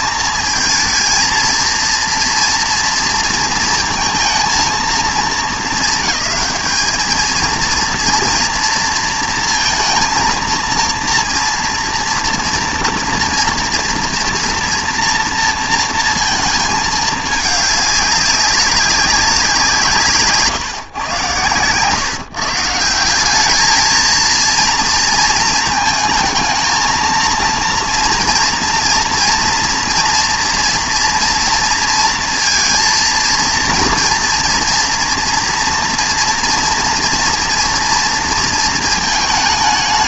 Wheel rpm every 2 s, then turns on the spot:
230, 230, 230, 220, 230, 230, 230, 230, 220, 190, 140, 160, 230, 230, 230, 240, 230, 230, 230, 230.
none